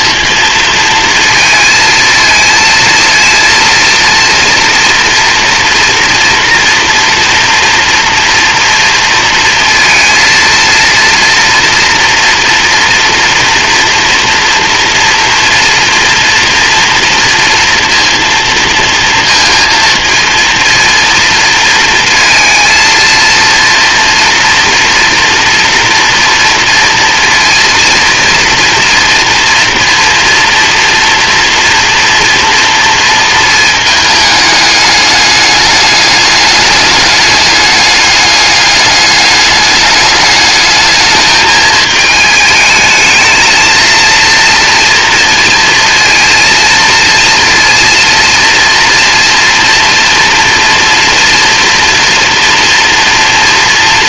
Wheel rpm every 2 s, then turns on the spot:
230, 230, 230, 230, 230, 230, 230, 230, 230, 230, 230, 230, 230, 230, 230, 230, 230, 210, 210, 210, 210, 220, 230, 230, 230, 230, 230.
none